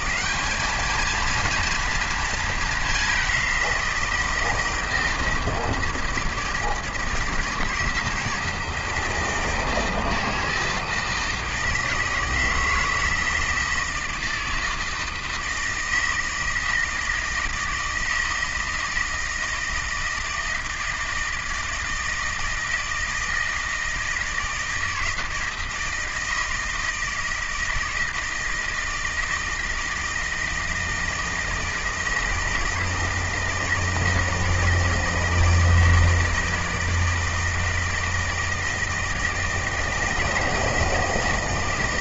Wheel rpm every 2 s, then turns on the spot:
210, 210, 160, 160, 160, 160, 160, 160, 160, 160, 160, 160, 160, 160, 160, 160, 160, 160, 160, 160, 160.
none